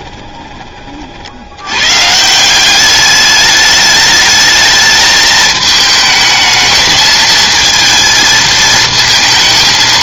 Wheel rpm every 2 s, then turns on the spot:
30, 190, 210, 220, 230.
none